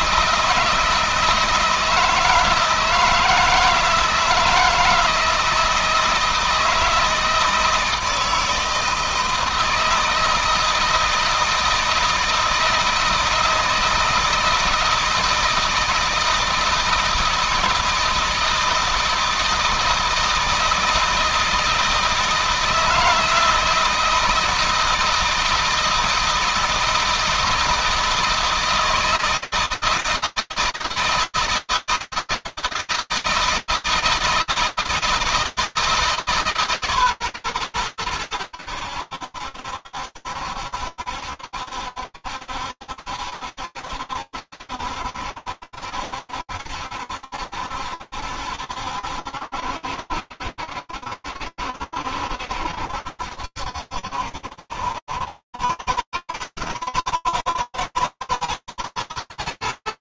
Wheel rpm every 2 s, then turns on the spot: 160, 160, 160, 160, 160, 160, 160, 160, 160, 160, 160, 160, 160, 160, 160, 160, 160, 160, 150, 90, 70, 70, 70, 70, 70, 70, 70, 70, 90, 110.
none